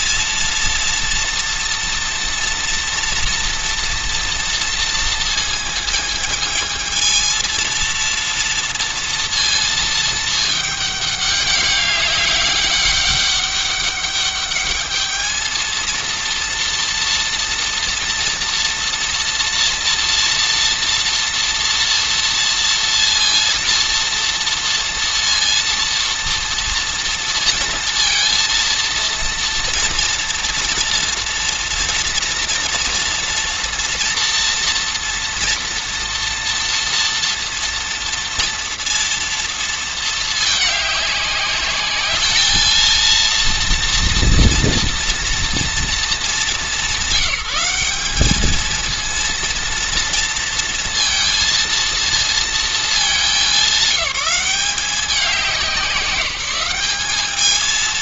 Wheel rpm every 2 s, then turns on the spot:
240, 230, 230, 220, 230, 210, 200, 210, 230, 230, 240, 230, 230, 230, 230, 230, 230, 230, 230, 230, 210, 220, 230, 200, 230, 230, 210, 190, 200.
none